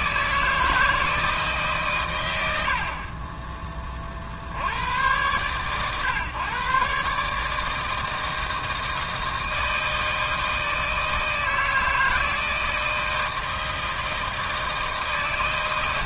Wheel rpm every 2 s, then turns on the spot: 160, 40, 90, 140, 160, 160, 160, 160.
none